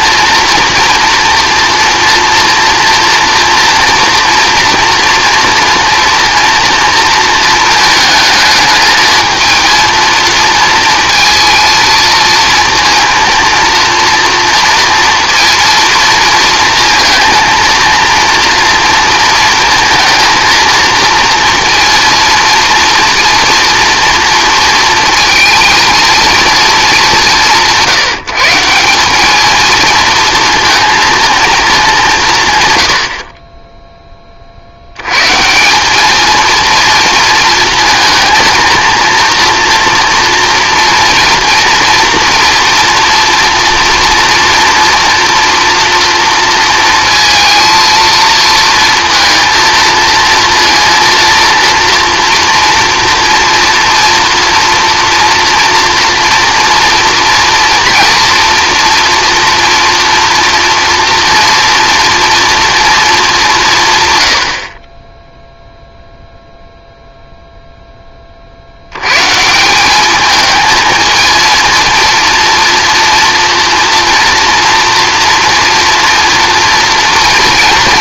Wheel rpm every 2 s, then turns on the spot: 230, 230, 230, 230, 220, 230, 230, 230, 230, 230, 230, 230, 230, 210, 190, 230, 110, 70, 230, 230, 230, 230, 230, 230, 230, 230, 230, 240, 230, 230, 230, 230, 50, 0, 80, 220, 230, 230, 230.
none